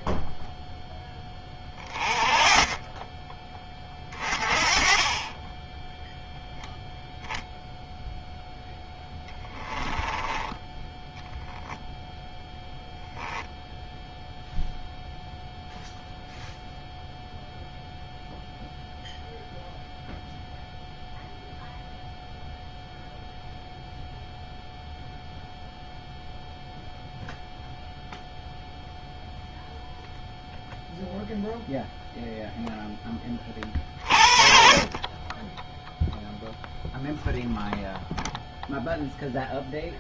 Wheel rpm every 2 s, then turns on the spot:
10, 20, 30, 0, 10, 10, 0, 0, 0, 0, 0, 0, 0, 0, 0, 0, 0, 40, 0, 0.
8-10